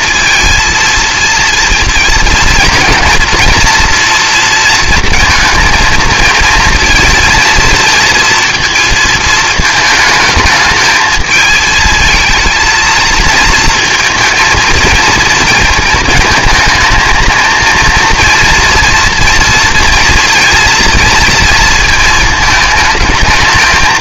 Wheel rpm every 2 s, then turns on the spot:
230, 230, 230, 230, 220, 220, 220, 230, 220, 230, 230, 220.
none